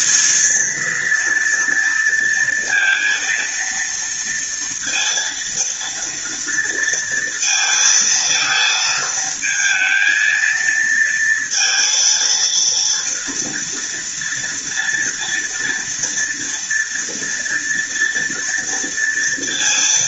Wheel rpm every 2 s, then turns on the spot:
230, 230, 230, 230, 220, 230, 230, 230, 230, 230.
none